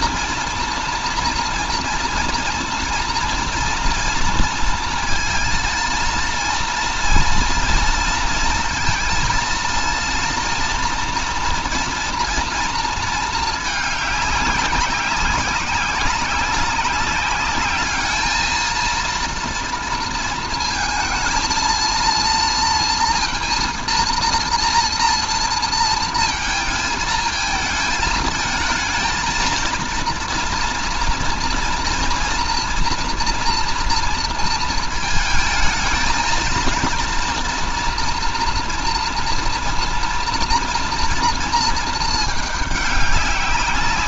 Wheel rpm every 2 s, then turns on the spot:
230, 230, 230, 230, 230, 230, 230, 200, 190, 220, 230, 230, 230, 220, 220, 230, 230, 230, 230, 230, 230, 220.
none